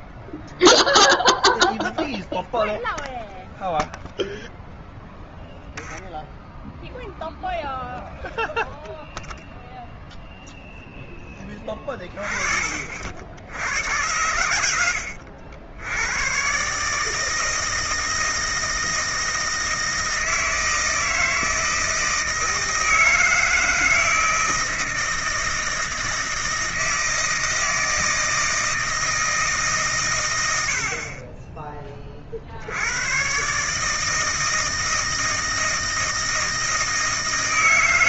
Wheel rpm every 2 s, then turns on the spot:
0, 0, 10, 0, 0, 20, 90, 100, 160, 160, 160, 160, 160, 160, 110, 40, 160, 160, 80.
4-6 36-38